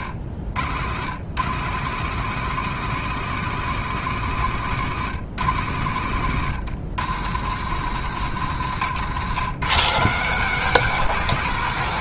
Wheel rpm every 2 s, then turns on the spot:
120, 170, 130, 130, 140, 170.
8-10